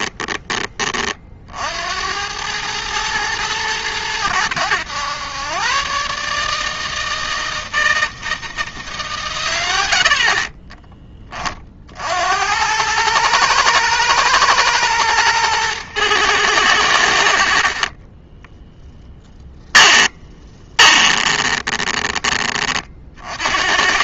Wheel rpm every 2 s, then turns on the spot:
30, 110, 100, 160, 150, 30, 100, 110, 90, 10, 30, 30.
10-12 18-22